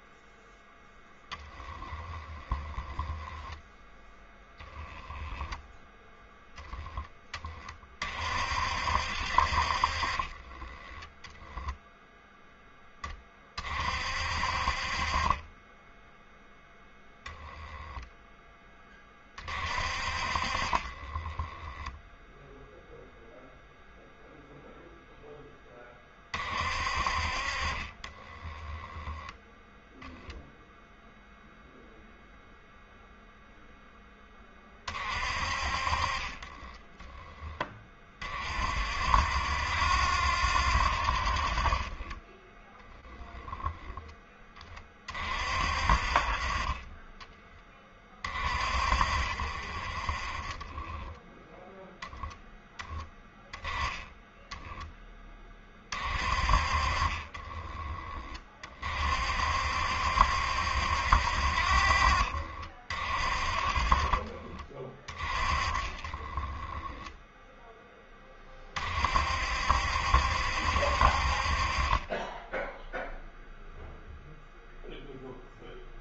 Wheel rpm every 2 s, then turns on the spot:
0, 10, 10, 10, 70, 20, 10, 50, 0, 30, 30, 0, 0, 50, 10, 0, 0, 40, 20, 50, 60, 20, 30, 30, 50, 20, 10, 10, 40, 40, 70, 50, 30, 10, 40, 70, 0, 0.
2-6 10-12 28-30 36-38 50-52 66-68